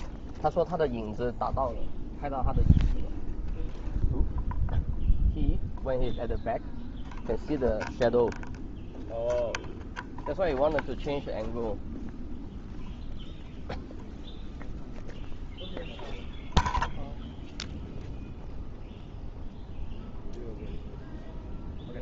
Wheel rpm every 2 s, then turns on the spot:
0, 0, 0, 0, 0, 0, 0, 0, 0, 0, 0.
none